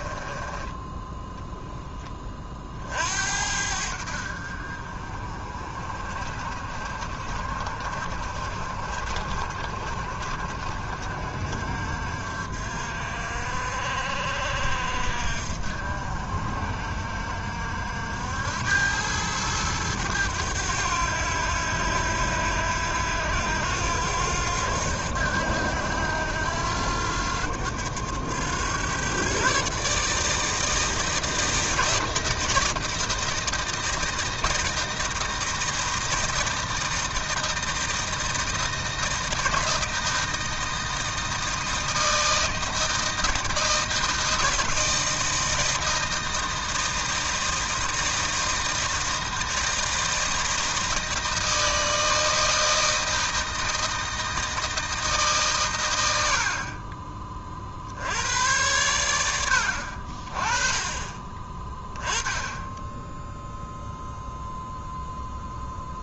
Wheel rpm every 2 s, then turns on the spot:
20, 40, 60, 50, 60, 60, 60, 60, 60, 90, 90, 80, 90, 90, 110, 160, 160, 160, 160, 160, 160, 160, 160, 160, 160, 160, 160, 160, 50, 100, 30, 10, 0.
0-2